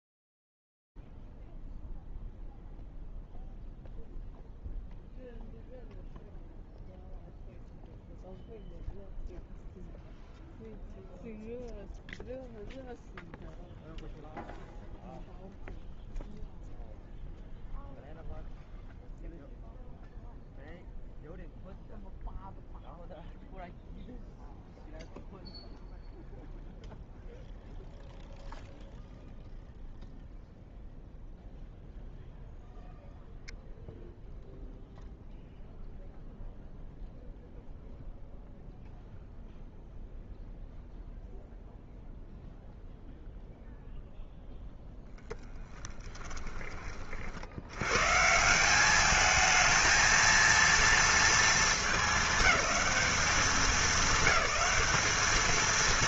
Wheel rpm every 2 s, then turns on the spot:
0, 0, 0, 0, 0, 0, 0, 0, 0, 0, 0, 0, 0, 0, 0, 0, 0, 0, 0, 0, 0, 0, 0, 20, 170, 230, 200, 210.
none